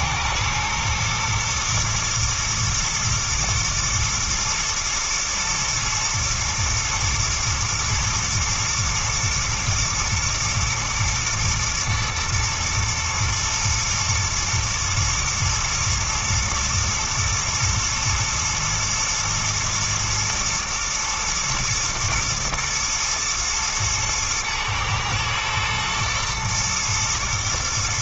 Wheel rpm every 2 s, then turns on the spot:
120, 110, 120, 120, 120, 120, 110, 110, 110, 120, 120, 110, 110, 120.
none